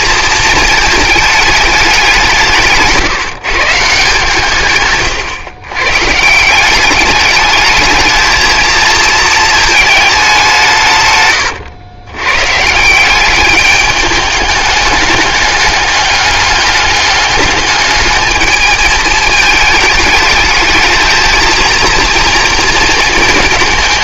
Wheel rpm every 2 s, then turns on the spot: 220, 170, 140, 170, 220, 180, 140, 210, 200, 220, 220, 230.
none